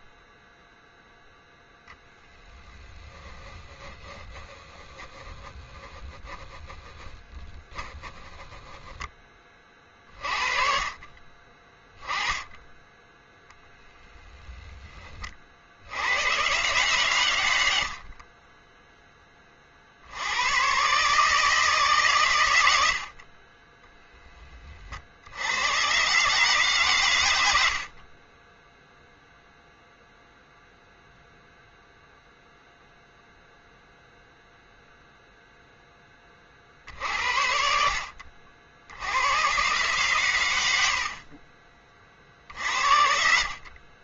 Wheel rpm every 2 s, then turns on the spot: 0, 0, 10, 20, 10, 40, 10, 10, 120, 10, 120, 100, 20, 140, 10, 0, 0, 0, 50, 60, 90, 50.
none